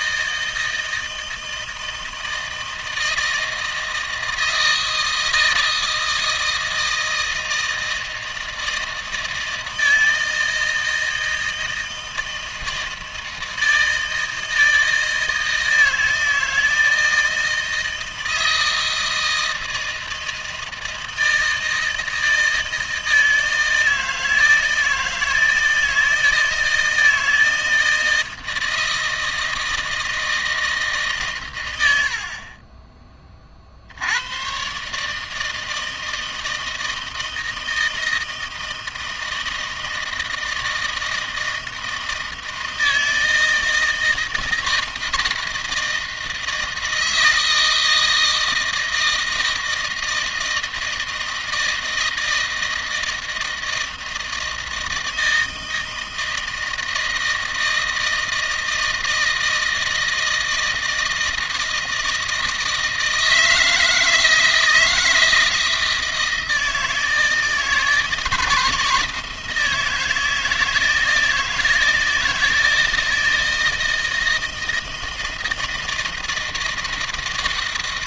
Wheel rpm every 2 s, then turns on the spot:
160, 160, 160, 160, 160, 160, 160, 160, 160, 160, 160, 160, 160, 160, 160, 160, 30, 130, 160, 160, 160, 160, 160, 160, 160, 160, 160, 160, 160, 160, 160, 160, 160, 160, 160, 160, 160, 160, 160.
none